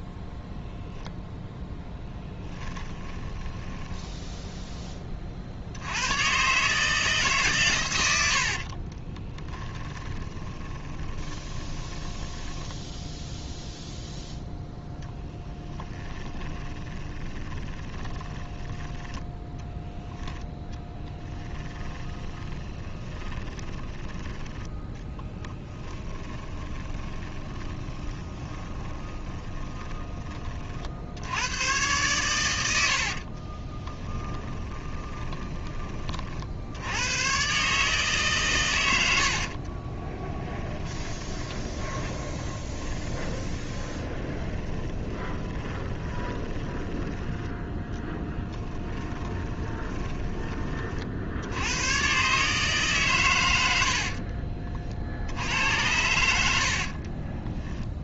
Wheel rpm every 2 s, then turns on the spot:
0, 10, 10, 150, 40, 20, 0, 0, 20, 10, 10, 20, 10, 20, 20, 50, 90, 20, 80, 100, 10, 10, 20, 10, 20, 30, 140, 40, 60.
2-4 8-12 16-18 20-30 32-36 40-50 56-58